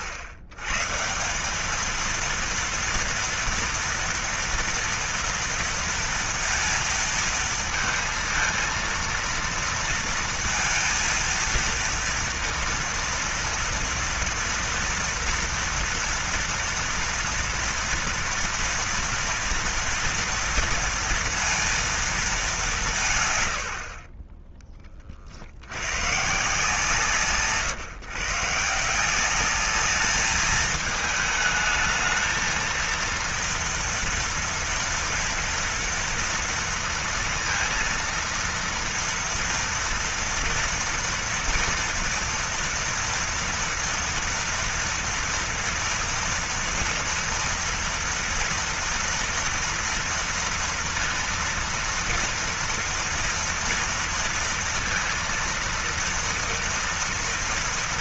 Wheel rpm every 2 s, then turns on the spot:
110, 230, 240, 230, 230, 230, 230, 230, 230, 230, 230, 200, 20, 150, 160, 220, 230, 230, 230, 230, 230, 230, 230, 230, 230, 230, 230, 230, 230.
none